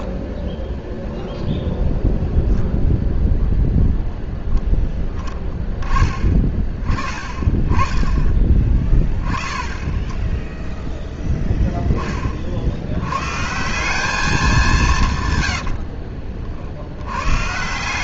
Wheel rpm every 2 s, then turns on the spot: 10, 0, 20, 30, 20, 10, 100, 160, 70.
none